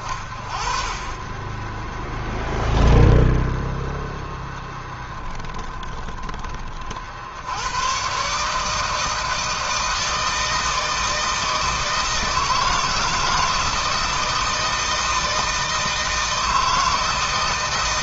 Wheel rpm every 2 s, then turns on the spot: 20, 10, 10, 70, 160, 160, 160, 160, 160.
4-6